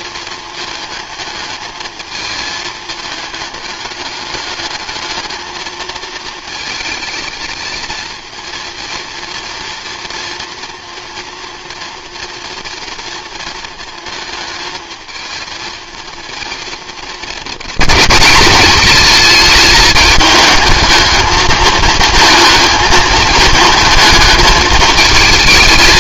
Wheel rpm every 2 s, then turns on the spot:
220, 220, 210, 220, 230, 230, 230, 220, 220, 210, 220, 220, 220.
none